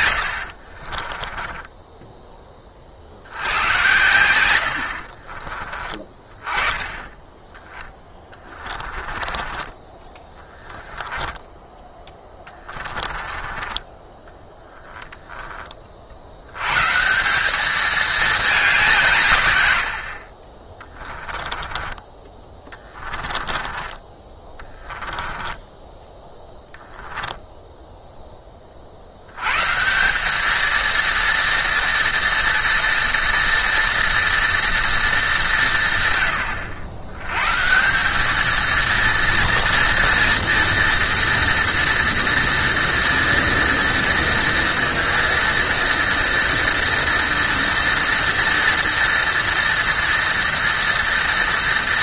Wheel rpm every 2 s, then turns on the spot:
50, 40, 60, 10, 20, 10, 20, 10, 130, 190, 40, 20, 20, 0, 40, 220, 230, 230, 100, 220, 230, 230, 230, 230, 230, 230.
0-2 8-14 22-26